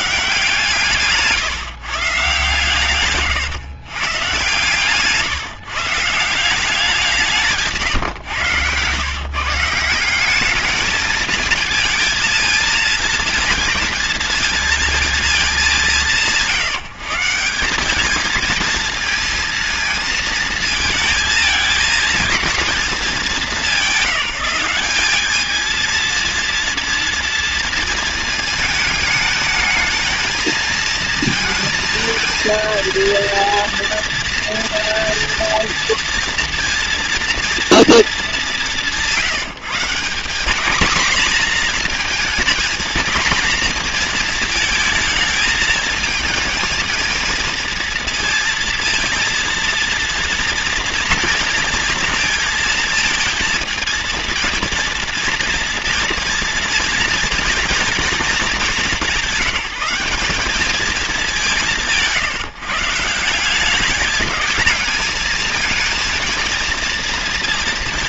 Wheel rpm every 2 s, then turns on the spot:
150, 130, 140, 180, 120, 210, 230, 230, 160, 220, 230, 220, 190, 230, 220, 230, 230, 230, 230, 200, 210, 220, 220, 230, 230, 230, 230, 230, 240, 210, 210, 160, 220, 230.
none